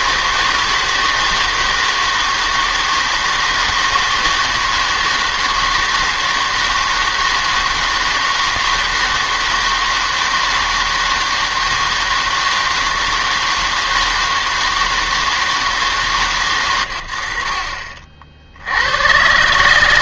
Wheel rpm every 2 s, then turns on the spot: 160, 160, 160, 160, 160, 160, 160, 160, 120, 80.
none